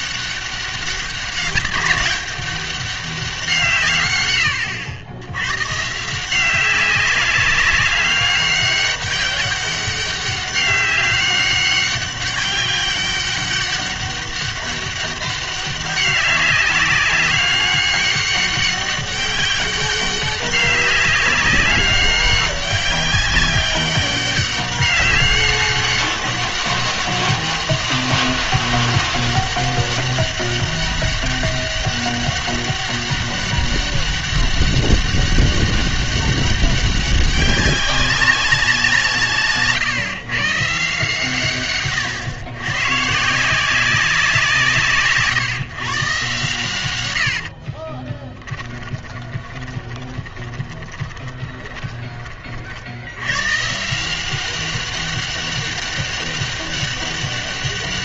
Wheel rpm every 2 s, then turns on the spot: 200, 200, 90, 190, 200, 190, 200, 200, 200, 200, 200, 200, 200, 200, 200, 200, 200, 200, 200, 190, 150, 120, 170, 110, 20, 20, 50, 190, 200.
48-52